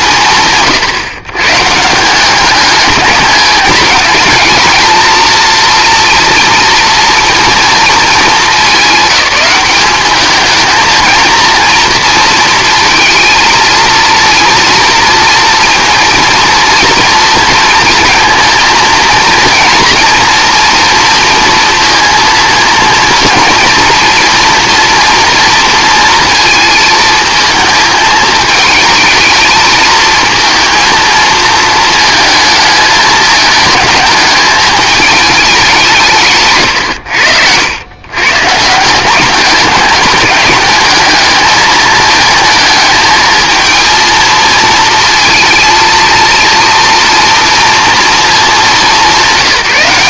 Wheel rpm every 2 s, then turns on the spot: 150, 200, 220, 230, 210, 210, 230, 230, 230, 230, 230, 230, 230, 220, 220, 220, 220, 210, 130, 150, 210, 220, 230, 230, 210.
none